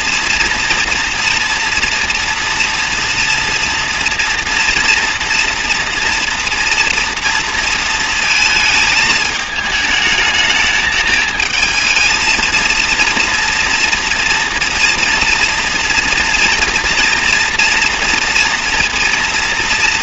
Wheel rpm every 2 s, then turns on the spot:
230, 230, 240, 230, 220, 220, 230, 230, 230, 230.
none